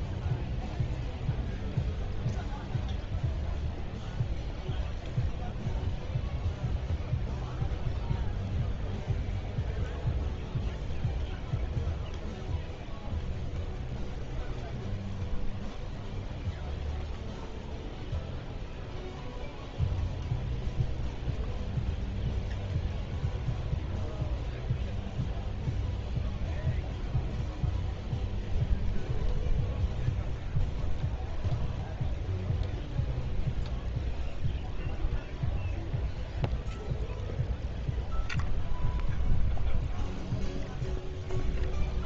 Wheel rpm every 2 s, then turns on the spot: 0, 0, 0, 0, 0, 0, 0, 0, 0, 0, 0, 0, 0, 0, 0, 0, 0, 0, 0, 0, 0.
none